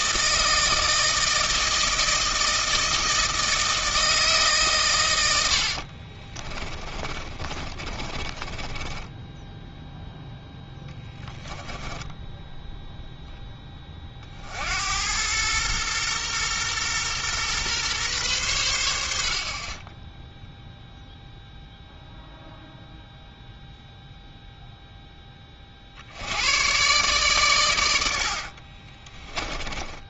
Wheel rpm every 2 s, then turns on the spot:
160, 160, 120, 30, 20, 10, 0, 80, 120, 80, 0, 0, 0, 120, 40.
6-10 28-30